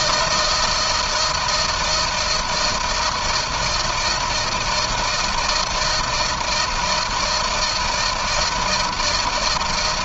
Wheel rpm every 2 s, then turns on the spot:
160, 170, 160, 160, 160.
none